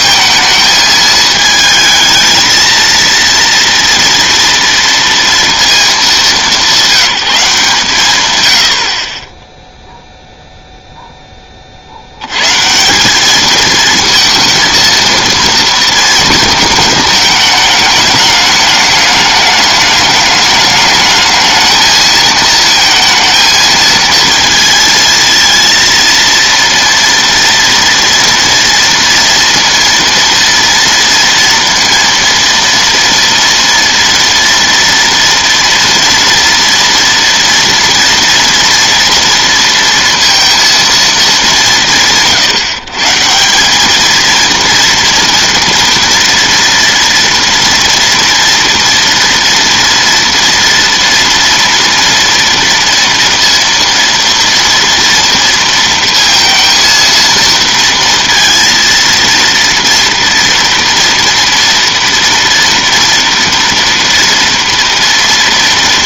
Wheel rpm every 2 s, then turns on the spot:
220, 230, 230, 190, 30, 0, 170, 230, 220, 210, 210, 230, 230, 230, 230, 230, 230, 230, 230, 230, 230, 150, 230, 230, 230, 230, 230, 230, 230, 230, 230, 240, 230.
none